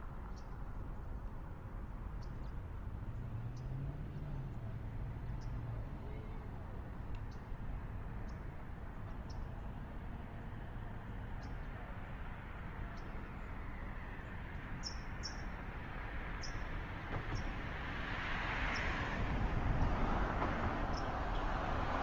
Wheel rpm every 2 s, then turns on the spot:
0, 0, 0, 0, 0, 0, 0, 0, 0, 0, 0.
none